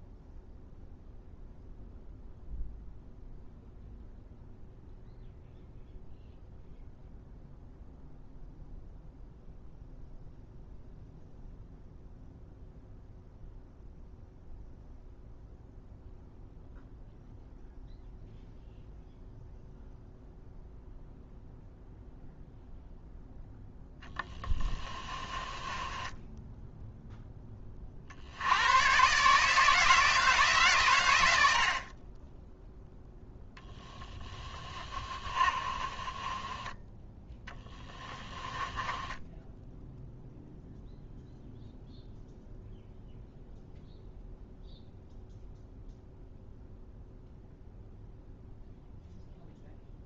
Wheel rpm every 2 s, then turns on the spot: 0, 0, 0, 0, 0, 0, 0, 0, 0, 0, 0, 0, 30, 0, 120, 110, 10, 30, 10, 10, 0, 0, 0, 0, 0.
24-26 34-36 38-40